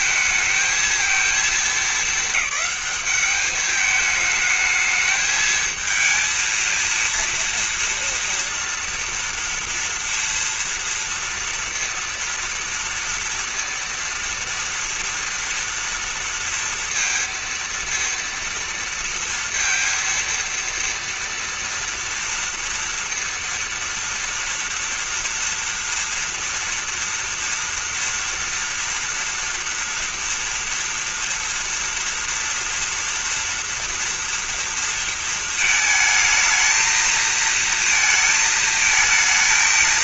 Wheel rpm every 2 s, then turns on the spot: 220, 210, 220, 230, 230, 230, 230, 230, 230, 230, 230, 230, 230, 230, 230, 230, 230, 230, 220, 230.
none